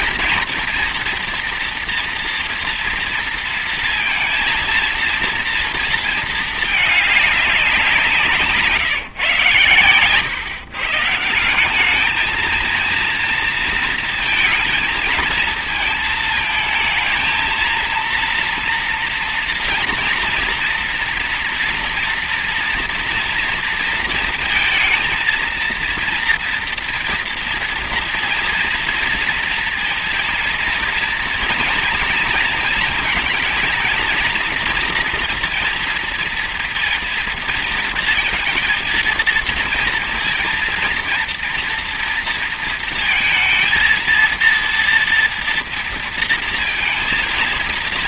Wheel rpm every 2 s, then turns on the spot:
230, 230, 230, 210, 140, 160, 230, 230, 220, 230, 230, 230, 230, 230, 230, 230, 230, 240, 230, 230, 230, 230, 230, 230.
none